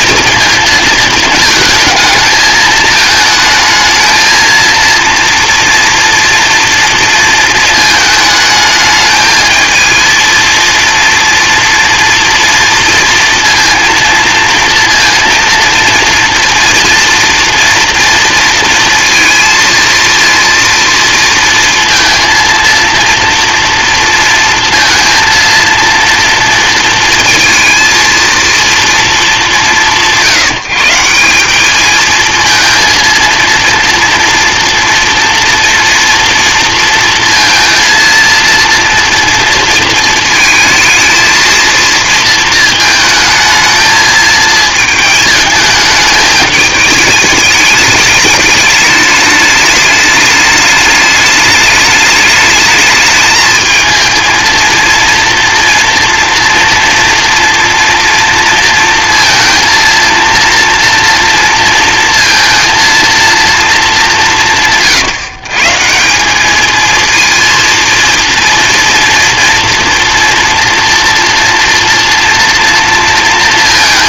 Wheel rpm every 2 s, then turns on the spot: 230, 220, 230, 230, 220, 230, 230, 230, 230, 230, 230, 230, 230, 230, 230, 160, 230, 230, 230, 230, 220, 220, 220, 220, 210, 210, 210, 220, 240, 230, 230, 230, 160, 220, 230, 230, 230.
none